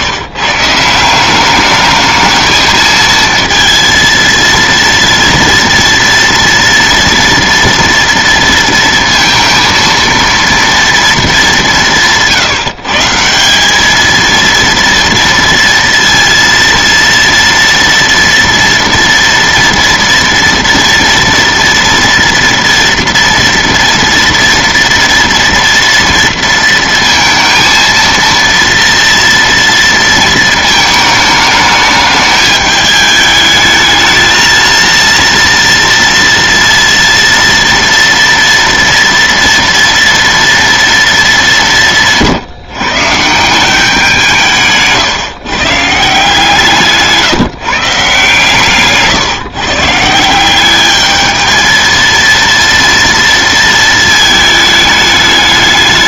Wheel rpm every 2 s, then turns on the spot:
150, 220, 230, 230, 230, 230, 160, 230, 230, 230, 230, 230, 230, 230, 230, 220, 210, 230, 230, 230, 230, 150, 160, 160, 140, 190, 230, 220.
48-50